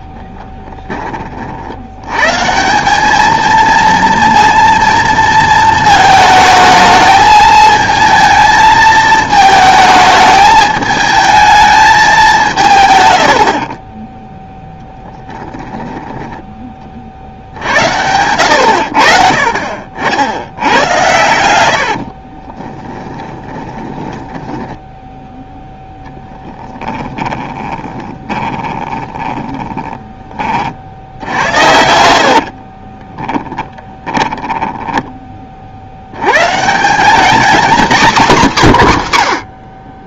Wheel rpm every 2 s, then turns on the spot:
10, 180, 230, 220, 220, 220, 120, 10, 50, 70, 100, 20, 10, 10, 30, 60, 40, 10, 180, 150.
14-16 22-30 32-36